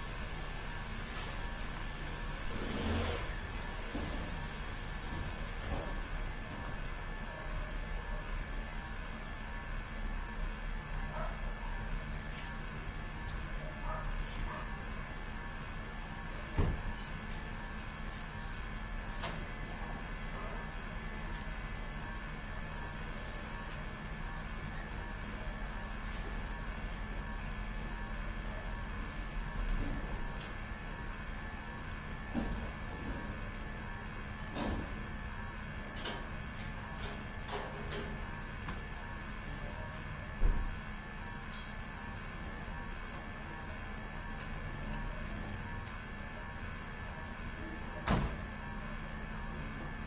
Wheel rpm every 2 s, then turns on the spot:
0, 0, 0, 0, 0, 0, 0, 0, 0, 0, 0, 0, 0, 0, 0, 0, 0, 0, 0, 0, 0, 0, 0, 0, 0.
none